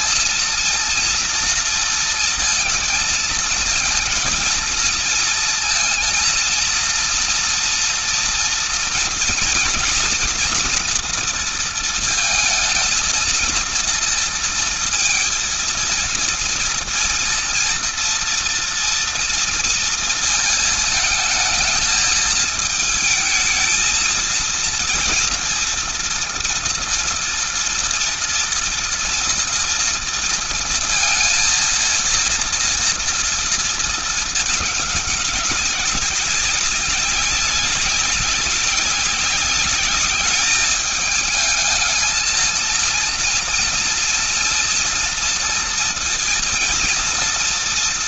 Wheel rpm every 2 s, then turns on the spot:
230, 230, 230, 230, 230, 230, 220, 230, 230, 230, 230, 220, 230, 240, 230, 230, 230, 220, 200, 190, 210, 220, 230, 230.
none